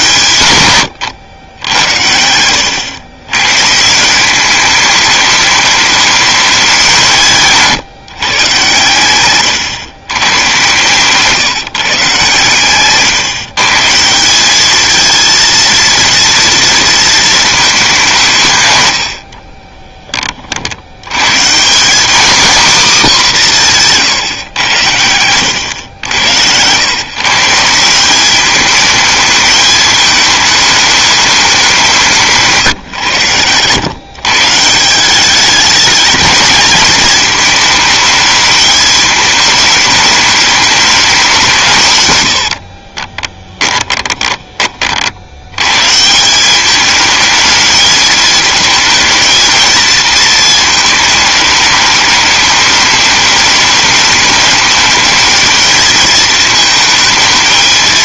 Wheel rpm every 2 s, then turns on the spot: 120, 90, 200, 200, 130, 120, 130, 200, 230, 140, 60, 250, 100, 110, 210, 210, 150, 150, 210, 220, 210, 80, 20, 190, 220, 220, 210, 210, 220.
42-44